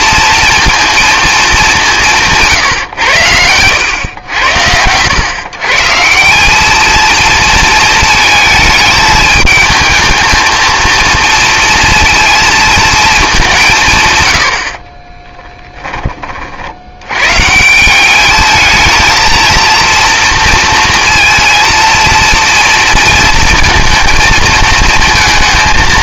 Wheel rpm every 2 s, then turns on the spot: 230, 140, 90, 210, 220, 230, 220, 60, 70, 220, 230, 230, 220.
none